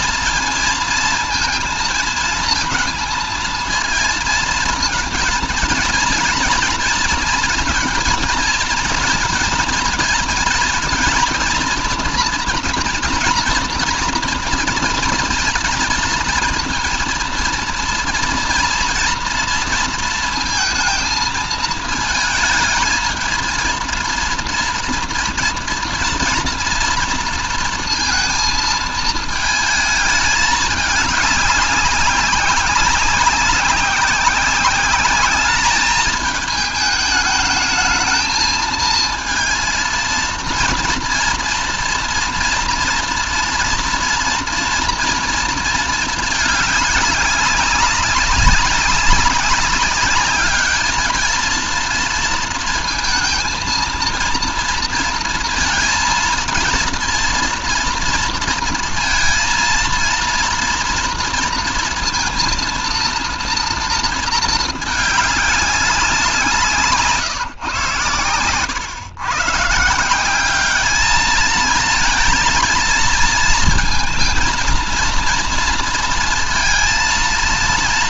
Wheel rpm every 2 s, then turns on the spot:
230, 220, 230, 230, 230, 230, 240, 220, 230, 230, 230, 220, 230, 230, 220, 210, 200, 200, 220, 220, 230, 230, 240, 200, 200, 210, 230, 230, 230, 230, 230, 230, 220, 160, 120, 200, 230, 230, 230.
none